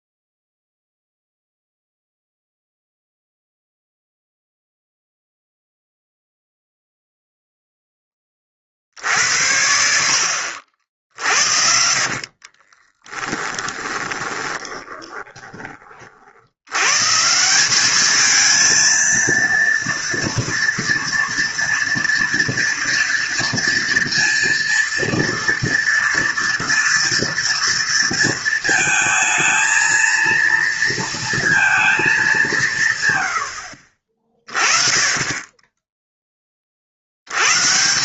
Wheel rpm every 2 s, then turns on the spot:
0, 0, 0, 0, 30, 60, 30, 20, 100, 220, 230, 230, 230, 230, 220, 230, 170, 30, 40.
12-16